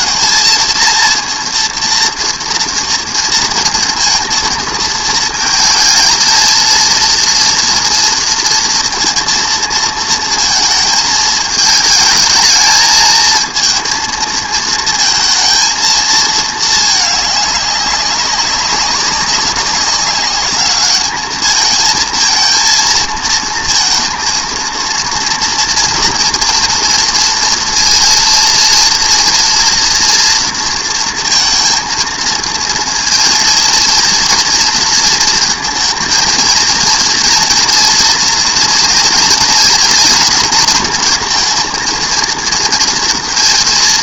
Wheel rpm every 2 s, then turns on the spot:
230, 230, 230, 230, 230, 220, 220, 220, 220, 190, 210, 230, 230, 230, 230, 230, 230, 230, 230, 230, 230, 230.
none